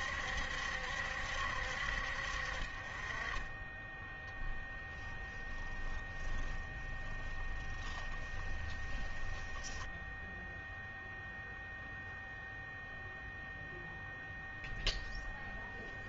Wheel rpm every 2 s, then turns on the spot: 70, 40, 10, 10, 10, 0, 0, 0.
4-10